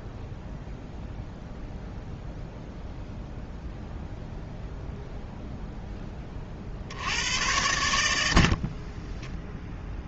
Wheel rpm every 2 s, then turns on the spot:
0, 0, 0, 50, 50.
none